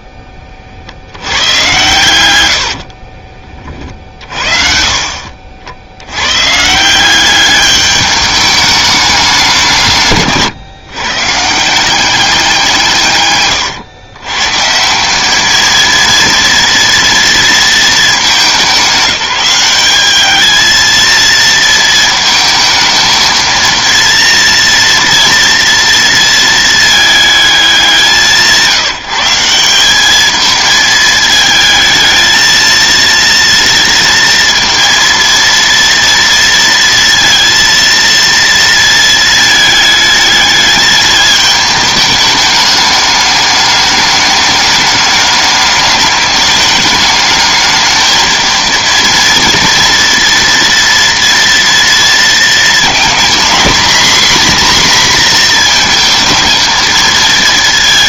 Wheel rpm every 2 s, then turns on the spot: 20, 80, 50, 140, 210, 130, 180, 150, 230, 200, 220, 220, 230, 220, 160, 220, 220, 230, 230, 230, 210, 210, 210, 210, 230, 230, 230, 260, 230.
2-4